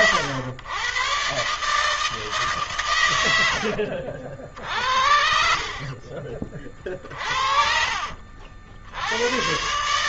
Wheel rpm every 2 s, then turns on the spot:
100, 140, 50, 30, 70.
6-8